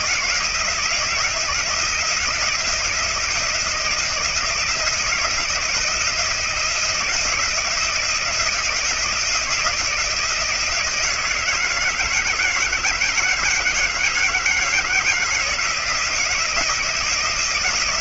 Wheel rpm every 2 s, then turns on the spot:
170, 170, 160, 170, 170, 170, 160, 160, 170.
none